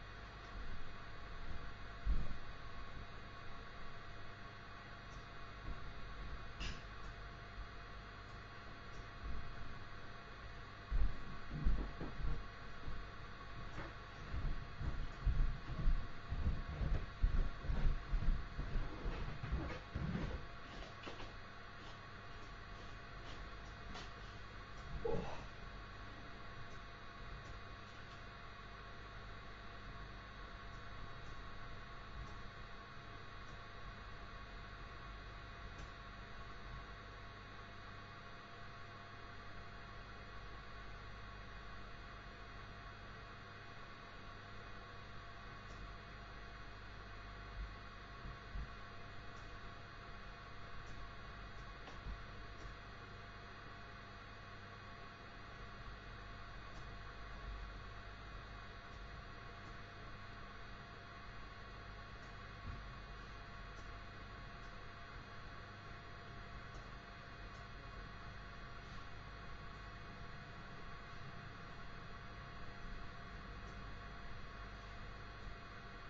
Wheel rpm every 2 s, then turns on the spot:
0, 0, 0, 0, 0, 0, 0, 0, 0, 0, 0, 0, 0, 0, 0, 0, 0, 0, 0, 0, 0, 0, 0, 0, 0, 0, 0, 0, 0, 0, 0, 0, 0, 0, 0, 0, 0, 0.
none